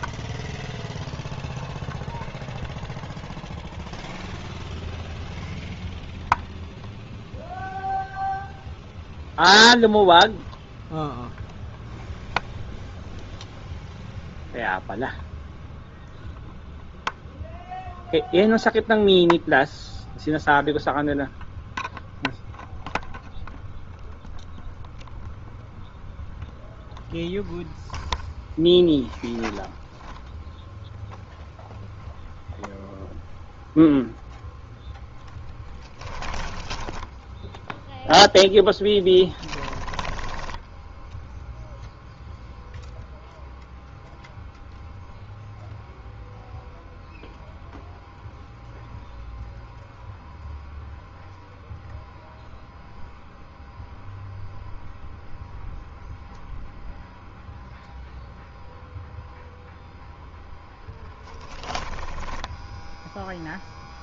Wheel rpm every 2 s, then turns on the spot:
0, 0, 0, 0, 0, 0, 0, 0, 0, 0, 0, 0, 0, 0, 0, 0, 0, 10, 0, 10, 0, 0, 0, 0, 0, 0, 0, 0, 0, 0, 10, 0.
38-40 60-62